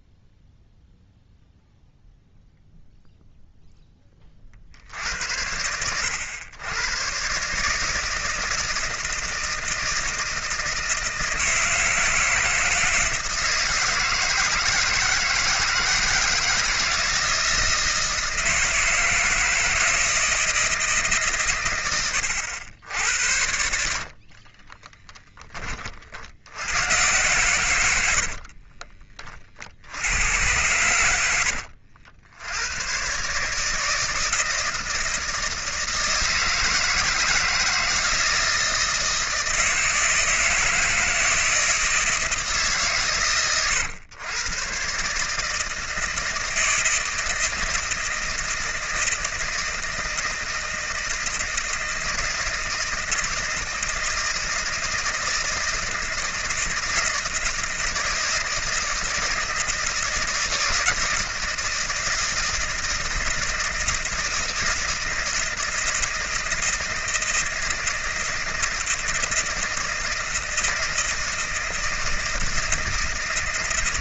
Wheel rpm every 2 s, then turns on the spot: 0, 0, 60, 100, 160, 160, 160, 160, 160, 160, 160, 80, 40, 90, 60, 100, 80, 160, 160, 160, 160, 160, 120, 160, 160, 160, 160, 160, 160, 170, 170, 160, 160, 160, 160, 160, 160.
24-26 28-30